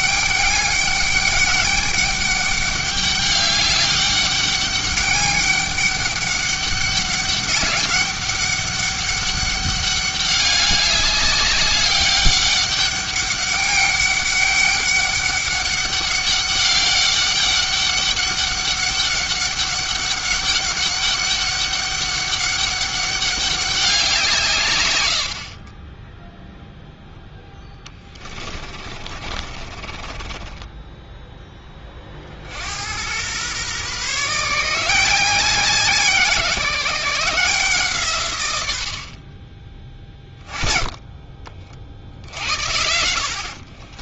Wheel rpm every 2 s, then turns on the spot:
200, 200, 200, 200, 200, 200, 200, 200, 200, 200, 200, 200, 120, 0, 30, 10, 90, 160, 160, 90, 20, 80.
28-32